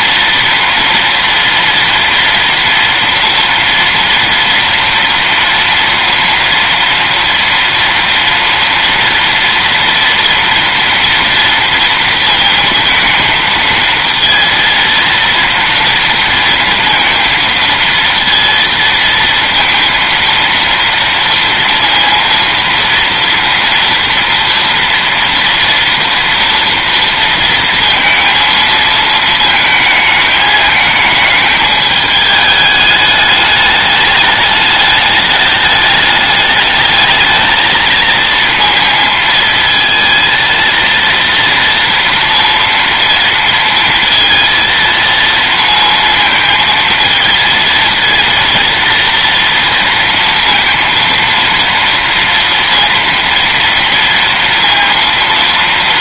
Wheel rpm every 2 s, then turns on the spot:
230, 230, 240, 230, 230, 230, 230, 230, 230, 230, 230, 230, 230, 230, 220, 220, 210, 210, 210, 230, 230, 230, 230, 220, 230, 230, 230, 230.
none